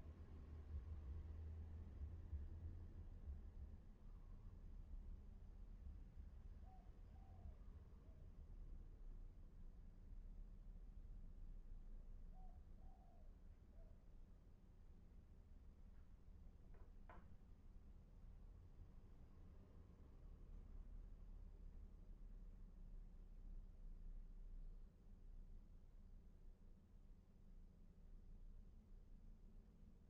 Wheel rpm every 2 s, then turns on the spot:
0, 0, 0, 0, 0, 0, 0, 0, 0, 0, 0, 0, 0, 0, 0.
none